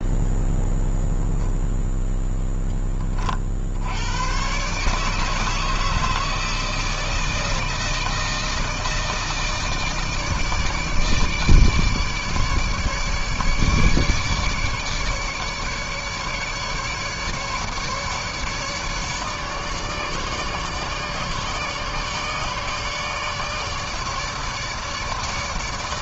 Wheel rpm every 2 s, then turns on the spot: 0, 30, 150, 160, 160, 150, 150, 150, 150, 150, 150, 150, 150.
none